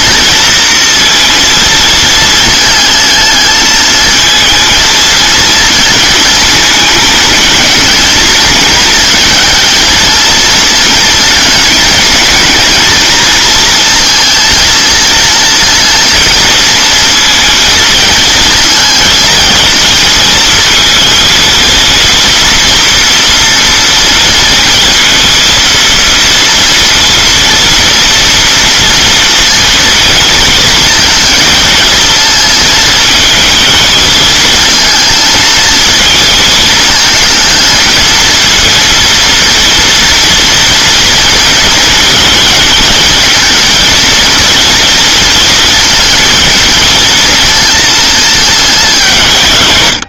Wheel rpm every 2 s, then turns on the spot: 230, 220, 220, 220, 220, 230, 230, 220, 230, 220, 230, 230, 230, 240, 230, 220, 220, 220, 220, 230, 230, 220, 220, 220, 200.
none